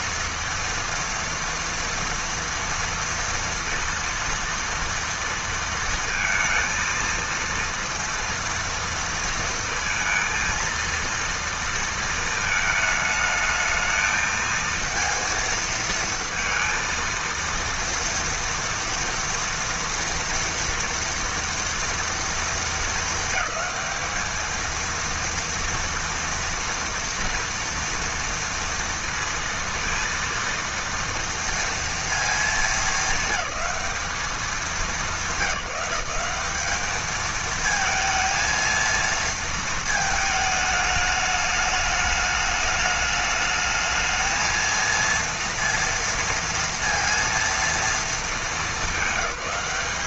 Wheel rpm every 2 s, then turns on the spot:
230, 230, 230, 230, 230, 230, 220, 220, 230, 230, 230, 230, 220, 230, 230, 230, 220, 210, 190, 230, 220, 210, 230, 230, 210.
none